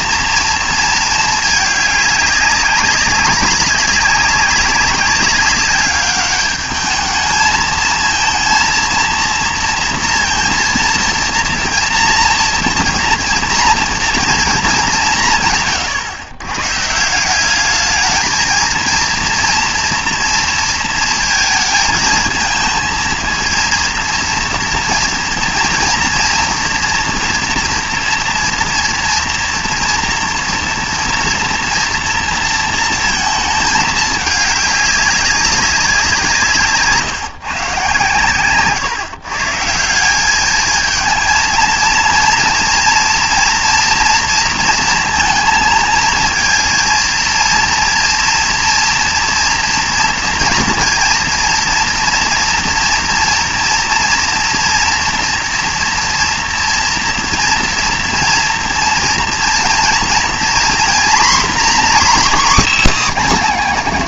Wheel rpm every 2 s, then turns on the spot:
230, 200, 200, 210, 230, 230, 230, 210, 120, 230, 230, 220, 240, 230, 230, 230, 230, 200, 140, 130, 210, 230, 230, 230, 230, 240, 230, 230, 230, 230, 240, 290.
none